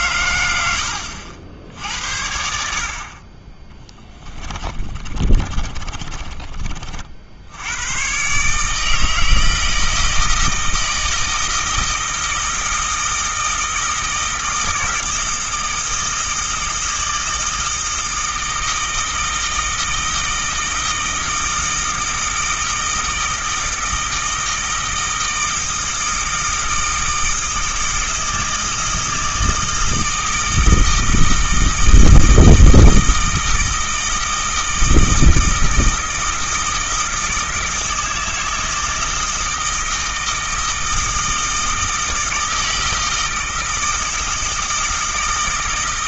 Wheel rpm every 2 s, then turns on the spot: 90, 50, 30, 40, 150, 160, 160, 160, 160, 160, 160, 160, 160, 160, 160, 160, 160, 160, 160, 160, 160, 160, 160.
4-6